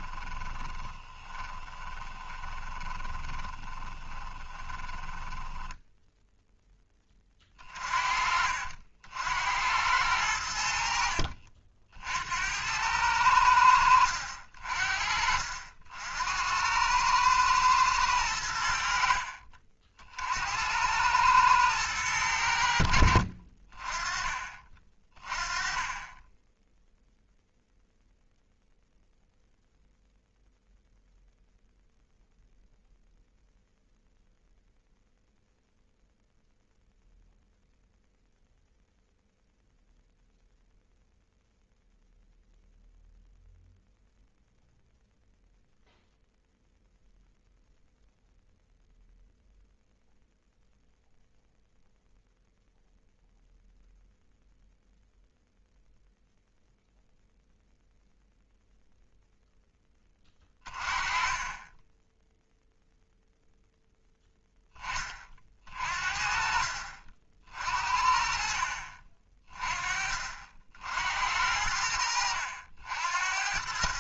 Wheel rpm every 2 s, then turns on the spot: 30, 20, 20, 10, 60, 80, 90, 50, 90, 90, 80, 80, 30, 10, 0, 0, 0, 0, 0, 0, 0, 0, 0, 0, 0, 0, 0, 0, 0, 0, 30, 0, 10, 50, 50, 60, 80.
0-6 68-70